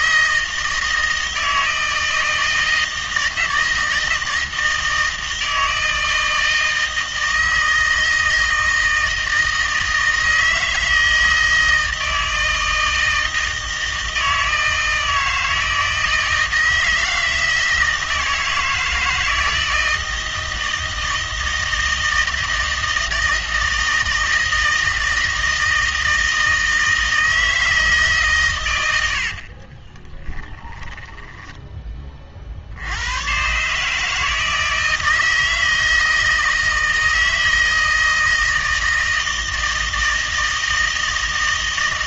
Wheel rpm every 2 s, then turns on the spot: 160, 160, 160, 160, 160, 160, 160, 160, 160, 160, 160, 160, 160, 160, 100, 10, 70, 160, 160, 160, 160.
30-32